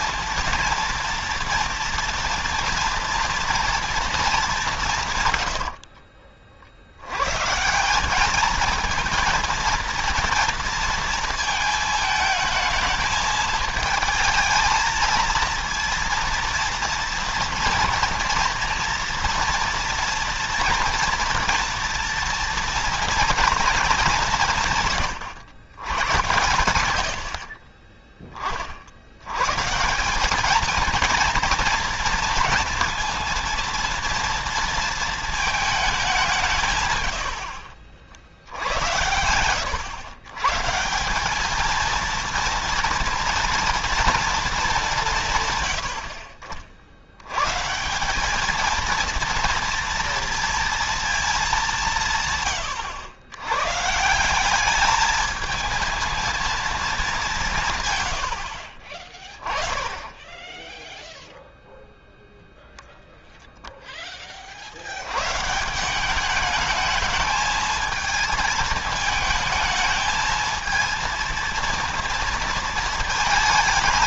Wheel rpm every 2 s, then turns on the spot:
230, 230, 190, 50, 220, 230, 220, 220, 230, 230, 240, 230, 160, 100, 30, 210, 230, 230, 150, 70, 150, 230, 210, 60, 220, 230, 110, 200, 220, 70, 10, 0, 50, 210, 220, 220, 230.
52-54